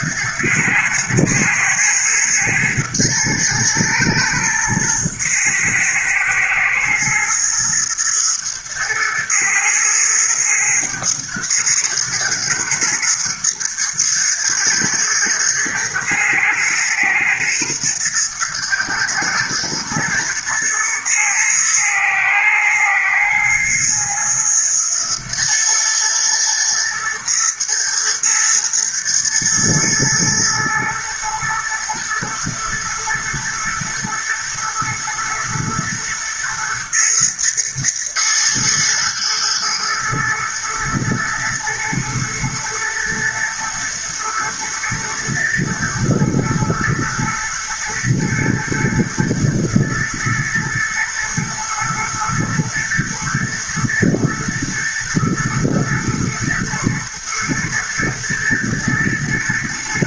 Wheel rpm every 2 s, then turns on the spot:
110, 110, 110, 120, 110, 110, 120, 120, 110, 120, 110, 110, 110, 110, 120, 110, 120, 110, 110, 110, 110, 110, 110, 110, 120, 110, 110, 120, 110, 110.
none